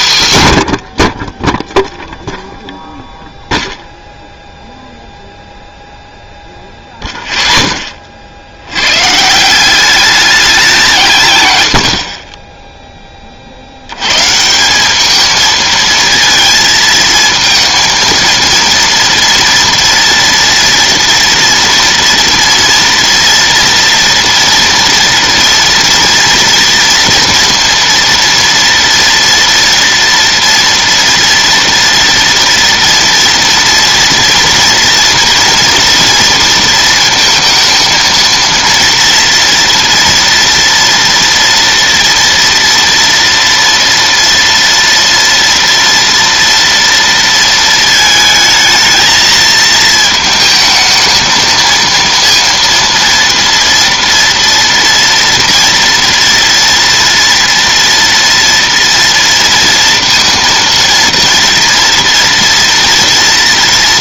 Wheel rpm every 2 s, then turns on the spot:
90, 0, 0, 0, 70, 190, 0, 170, 220, 230, 240, 240, 230, 230, 230, 240, 230, 230, 230, 230, 230, 240, 230, 230, 220, 220, 230, 230, 230, 230, 230, 230.
none